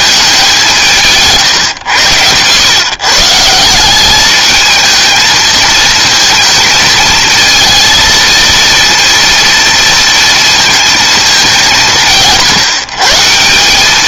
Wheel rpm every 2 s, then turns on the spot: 210, 110, 200, 220, 230, 230, 160.
none